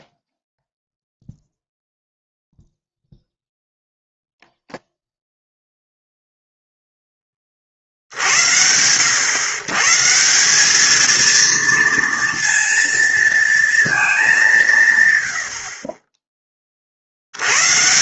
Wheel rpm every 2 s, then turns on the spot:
0, 0, 0, 0, 80, 190, 230, 200, 30.
none